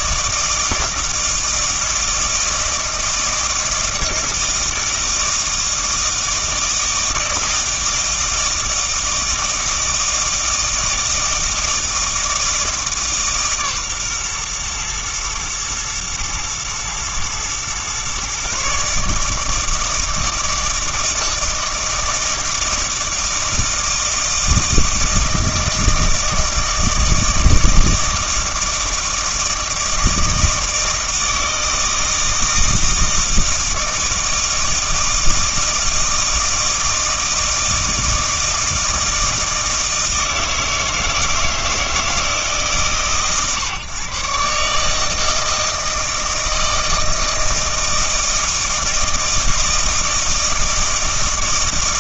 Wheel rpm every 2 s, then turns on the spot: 160, 160, 160, 160, 160, 160, 160, 120, 110, 140, 160, 160, 160, 160, 160, 160, 160, 160, 160, 160, 160, 150, 150, 160, 160, 160.
none